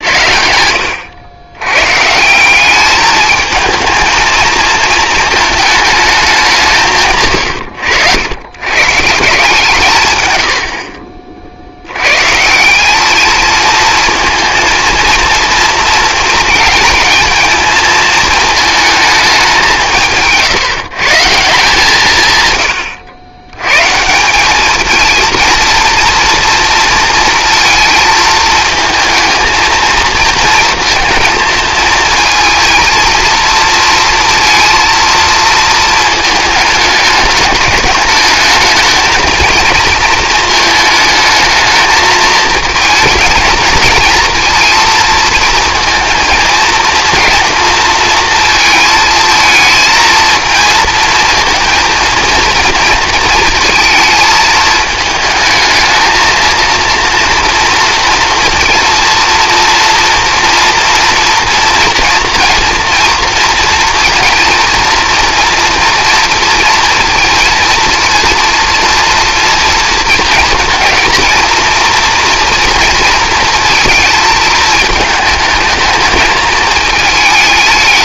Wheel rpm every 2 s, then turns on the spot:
80, 200, 220, 170, 120, 80, 180, 230, 230, 220, 160, 120, 210, 230, 220, 230, 230, 230, 220, 220, 220, 220, 230, 220, 230, 230, 230, 220, 230, 230, 230, 230, 230, 230, 230, 230, 230, 220, 220.
none